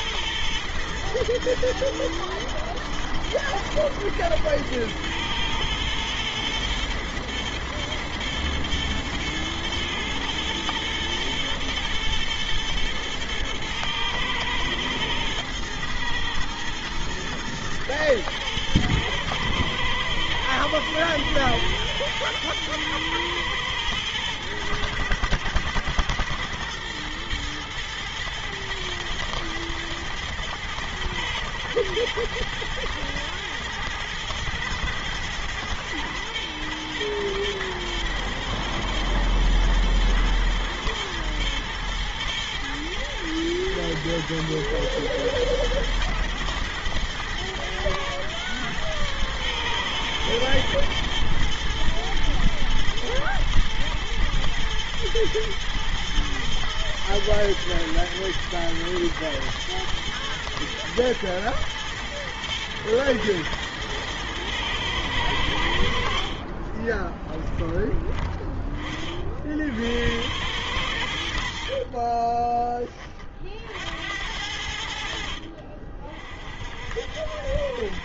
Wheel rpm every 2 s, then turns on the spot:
110, 120, 110, 110, 110, 120, 110, 110, 110, 110, 110, 110, 120, 120, 120, 120, 120, 110, 120, 110, 120, 110, 120, 120, 120, 110, 110, 110, 120, 110, 120, 120, 100, 30, 50, 80, 50, 60, 60.
70-72